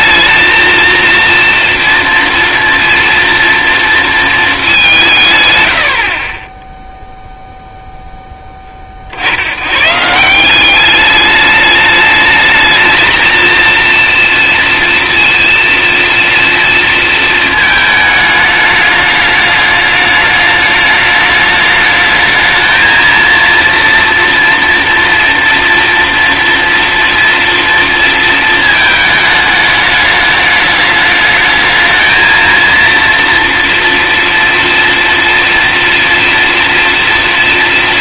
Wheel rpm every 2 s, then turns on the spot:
230, 230, 180, 0, 30, 190, 220, 230, 230, 210, 210, 230, 230, 230, 220, 210, 230, 230, 240.
none